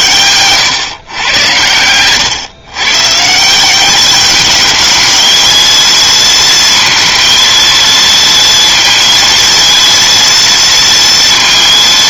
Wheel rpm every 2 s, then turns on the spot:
120, 130, 210, 230, 230, 230.
none